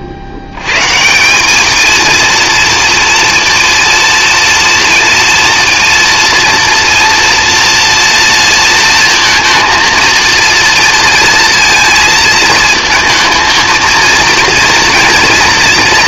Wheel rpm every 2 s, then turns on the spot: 100, 230, 230, 230, 230, 230, 220, 230.
none